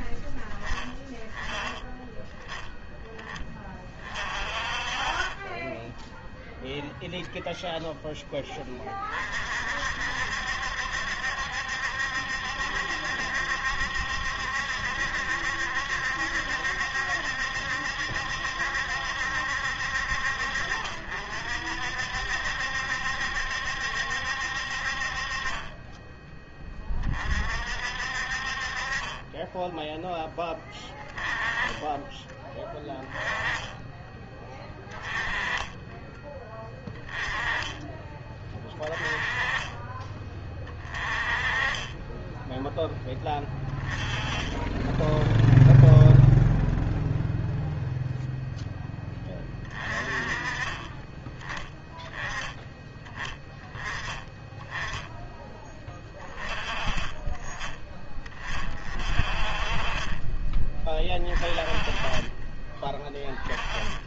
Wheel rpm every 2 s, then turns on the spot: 10, 10, 40, 0, 30, 70, 70, 70, 70, 70, 60, 70, 50, 30, 40, 10, 10, 10, 10, 20, 20, 10, 10, 0, 10, 20, 10, 10, 20, 40, 20, 20.
none